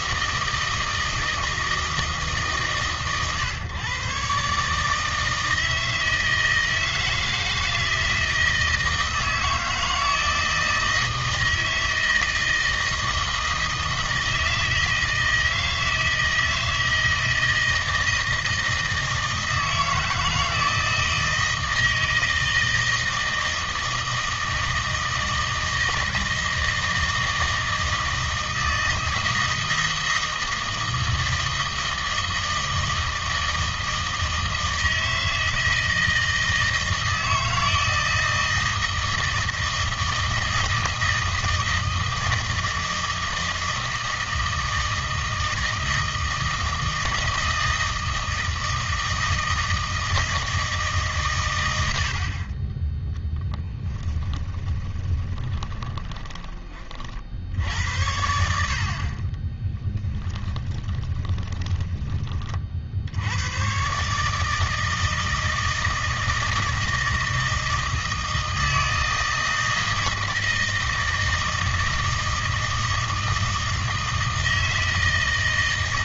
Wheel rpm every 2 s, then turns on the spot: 160, 150, 140, 160, 160, 160, 160, 160, 160, 160, 160, 160, 160, 160, 160, 160, 160, 160, 160, 160, 160, 160, 160, 160, 160, 160, 20, 20, 30, 70, 20, 40, 160, 160, 160, 160, 160, 160.
54-56 60-62